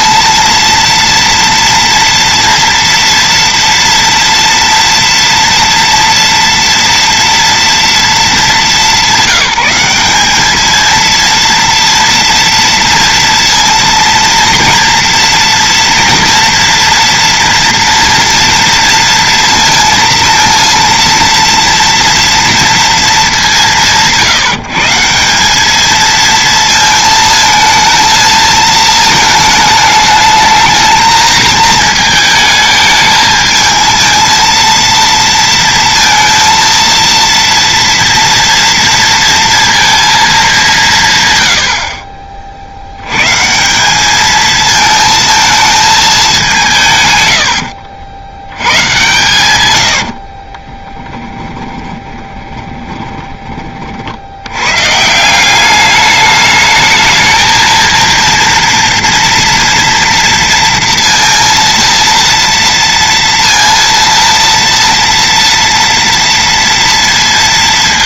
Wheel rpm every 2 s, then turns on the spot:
230, 230, 230, 230, 210, 220, 230, 230, 230, 230, 230, 230, 160, 230, 220, 220, 220, 230, 230, 230, 180, 50, 220, 160, 110, 30, 20, 110, 220, 230, 230, 230, 230, 230.
50-54